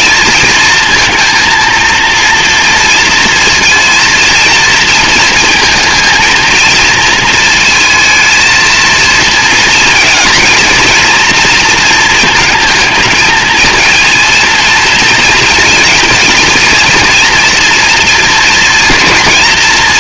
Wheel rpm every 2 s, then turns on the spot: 230, 230, 230, 230, 230, 230, 220, 230, 240, 230.
none